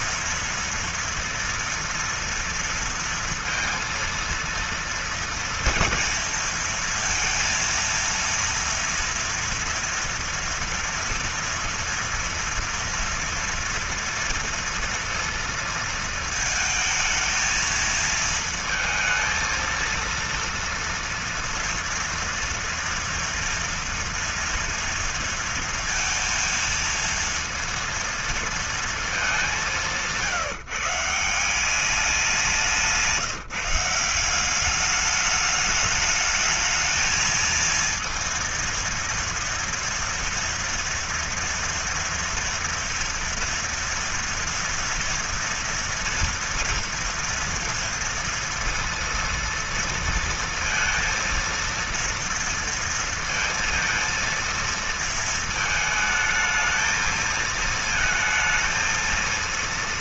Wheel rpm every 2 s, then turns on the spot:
230, 230, 230, 230, 230, 230, 230, 230, 220, 230, 230, 240, 230, 230, 220, 170, 180, 200, 220, 230, 230, 240, 230, 230, 230, 230, 230, 230, 220, 230.
none